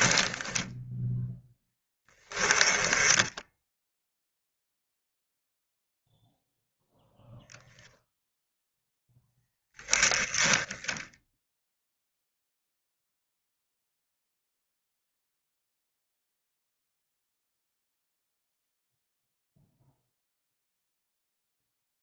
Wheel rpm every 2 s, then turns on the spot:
0, 10, 0, 0, 10, 10, 0, 0, 0, 0, 0.
none